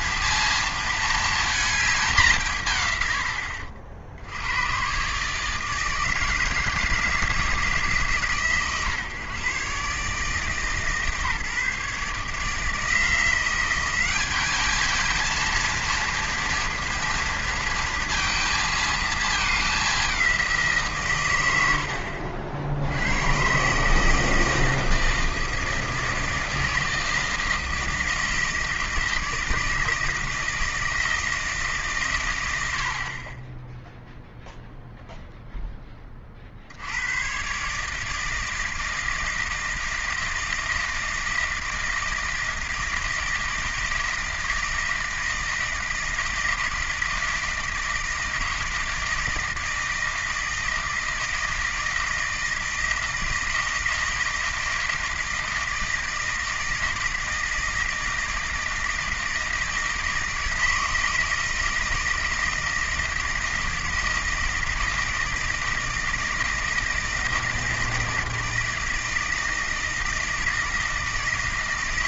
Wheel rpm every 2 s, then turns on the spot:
230, 140, 120, 160, 140, 150, 160, 220, 230, 220, 160, 70, 160, 160, 160, 160, 110, 0, 70, 160, 160, 160, 160, 160, 160, 160, 160, 160, 160, 160, 160, 160, 160, 160, 160, 160.
none